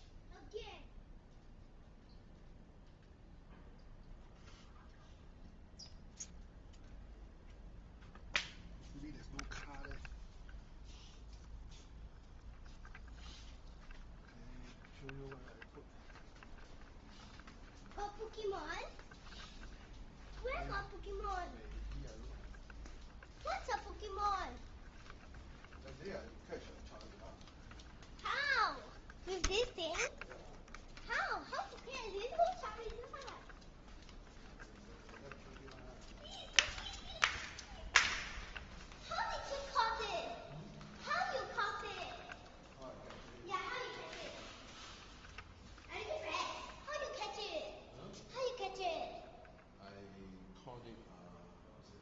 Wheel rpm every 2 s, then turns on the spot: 0, 0, 0, 0, 0, 0, 0, 0, 0, 0, 0, 0, 0, 0, 0, 0, 0, 0, 0, 0, 0, 0, 0, 0, 0, 0.
none